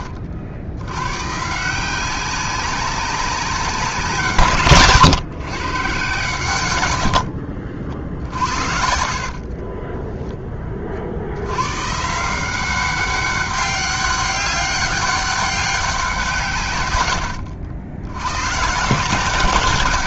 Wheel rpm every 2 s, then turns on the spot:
100, 200, 140, 100, 70, 40, 190, 200, 110, 160.
6-10